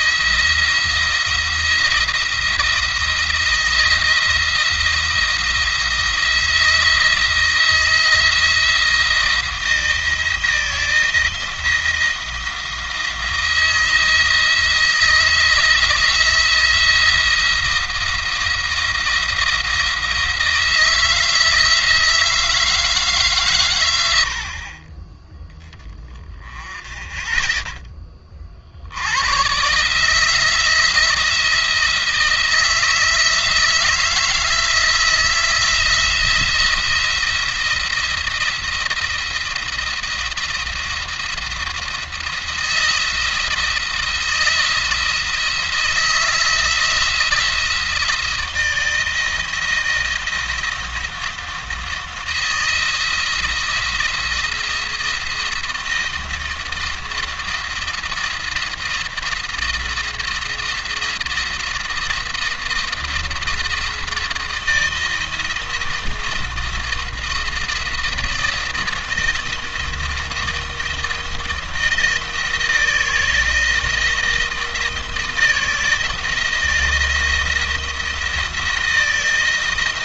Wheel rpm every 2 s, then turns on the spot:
170, 170, 170, 170, 170, 170, 170, 160, 170, 170, 160, 160, 30, 20, 90, 170, 170, 170, 170, 170, 170, 170, 160, 170, 170, 170, 170, 170, 170, 170, 170, 170, 170, 170, 170, 170, 160, 170, 170, 170.
none